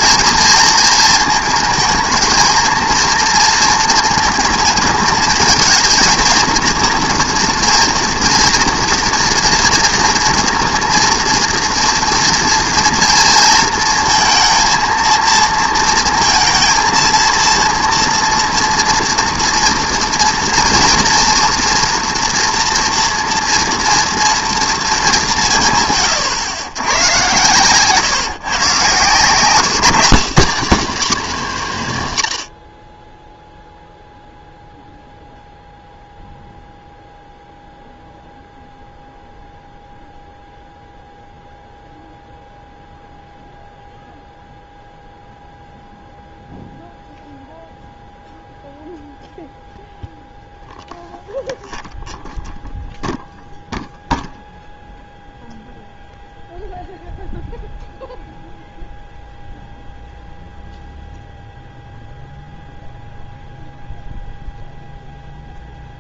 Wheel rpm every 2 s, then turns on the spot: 220, 230, 220, 230, 230, 230, 230, 230, 230, 230, 230, 230, 120, 130, 170, 170, 0, 0, 0, 0, 0, 0, 0, 0, 0, 0, 0, 0, 0, 0, 0, 0, 0.
none